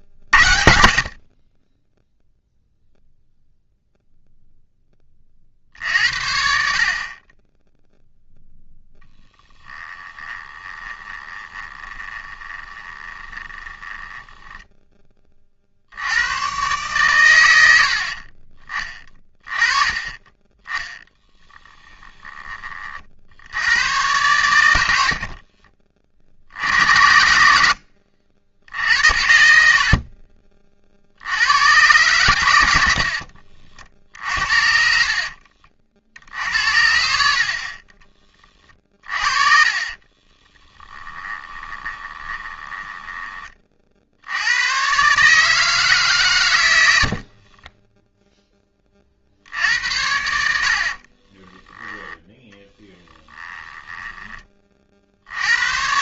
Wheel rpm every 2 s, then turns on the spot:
60, 0, 10, 50, 0, 20, 20, 10, 120, 30, 20, 30, 90, 80, 80, 50, 80, 50, 80, 30, 10, 20, 100, 100, 20, 60, 20, 30.
10-14 20-22 38-44 52-54